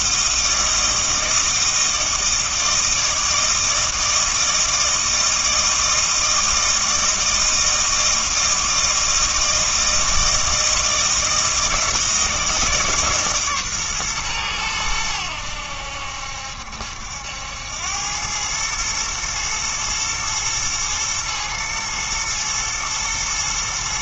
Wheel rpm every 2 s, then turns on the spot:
160, 160, 160, 160, 160, 160, 160, 110, 70, 110, 110, 120.
none